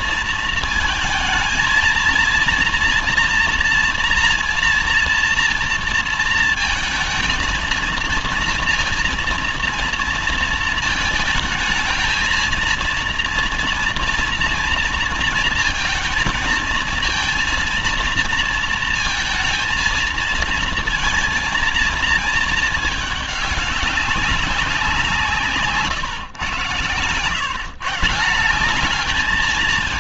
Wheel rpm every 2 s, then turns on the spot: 230, 230, 230, 220, 230, 220, 220, 230, 230, 230, 230, 220, 190, 120, 180.
none